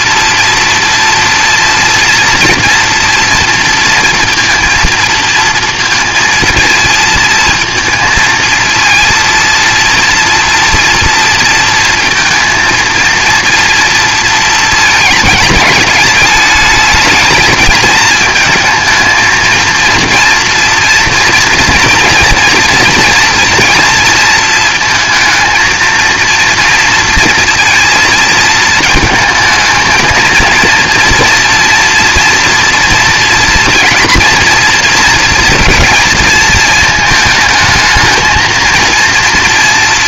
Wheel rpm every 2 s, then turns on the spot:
240, 240, 230, 230, 230, 230, 230, 230, 210, 220, 230, 230, 220, 230, 220, 230, 240, 240, 220, 230.
none